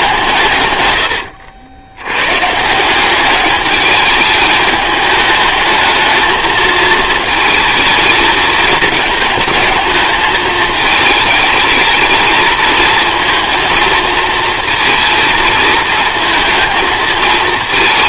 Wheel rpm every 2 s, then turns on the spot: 130, 150, 210, 220, 220, 220, 220, 230, 220.
none